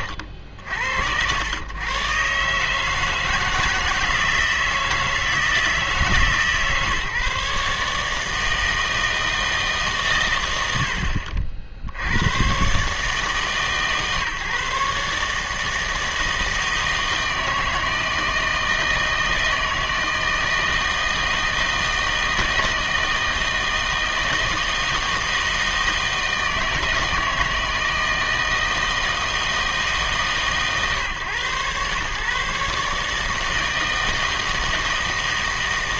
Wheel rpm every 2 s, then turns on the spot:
80, 140, 160, 140, 160, 100, 120, 140, 160, 160, 160, 160, 160, 160, 160, 140, 140, 160.
none